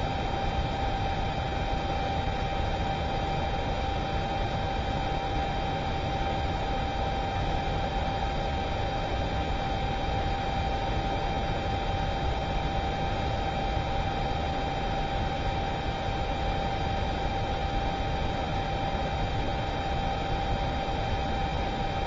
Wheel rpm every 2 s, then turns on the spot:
0, 0, 0, 0, 0, 0, 0, 0, 0, 0, 0.
none